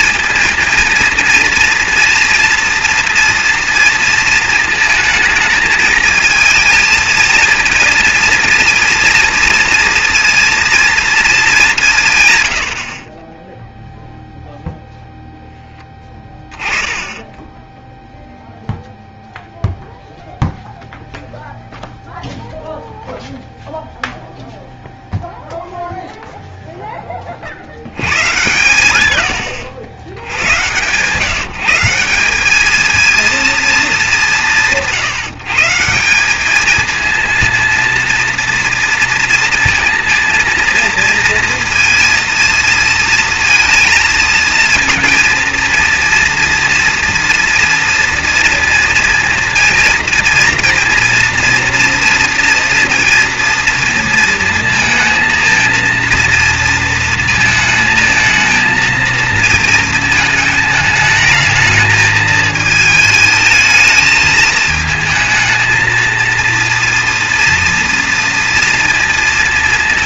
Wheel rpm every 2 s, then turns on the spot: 230, 230, 230, 220, 230, 230, 80, 0, 20, 0, 0, 0, 0, 0, 100, 110, 200, 170, 210, 230, 230, 230, 220, 230, 230, 230, 230, 230, 230, 230, 220, 220, 220, 230, 230.
16-18